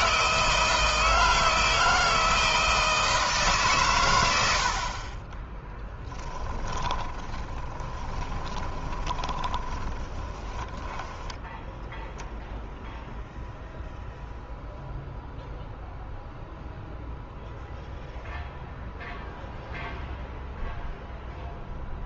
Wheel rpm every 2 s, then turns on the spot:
160, 160, 80, 20, 20, 10, 0, 0, 0, 0, 0.
6-12